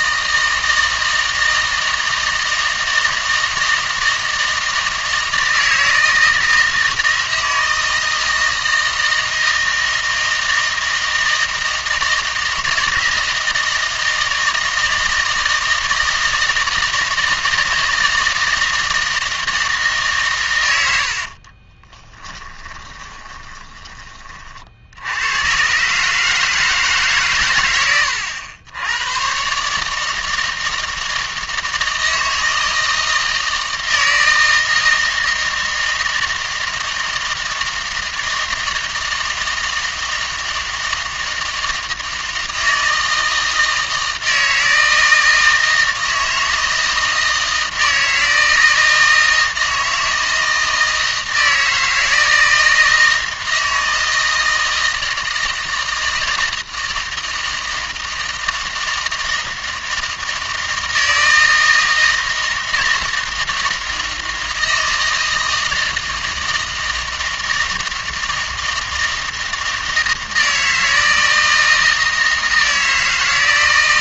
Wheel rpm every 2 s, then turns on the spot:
160, 160, 160, 160, 160, 160, 160, 160, 160, 160, 90, 20, 60, 150, 100, 160, 160, 160, 160, 160, 160, 160, 160, 160, 160, 160, 160, 160, 160, 160, 160, 160, 160, 160, 160, 160, 160.
22-24